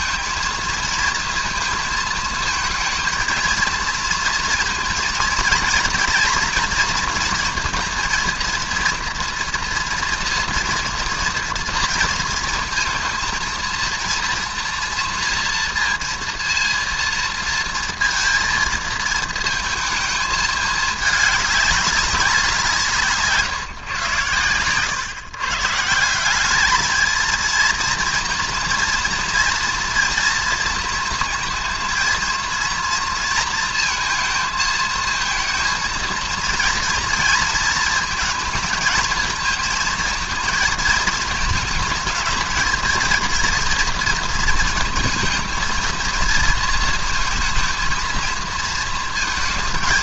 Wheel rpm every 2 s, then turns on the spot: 230, 220, 230, 230, 230, 230, 230, 230, 230, 230, 210, 180, 110, 200, 230, 230, 230, 220, 230, 220, 230, 220, 230, 230, 230.
none